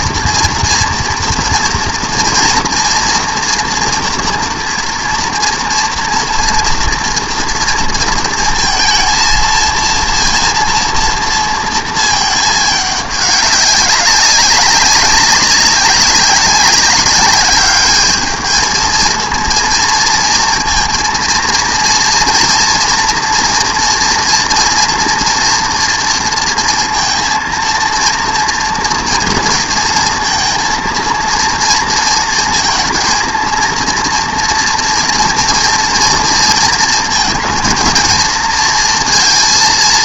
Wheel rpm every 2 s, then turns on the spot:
230, 230, 230, 230, 230, 230, 210, 190, 190, 220, 230, 240, 230, 230, 230, 230, 230, 240, 230, 230.
none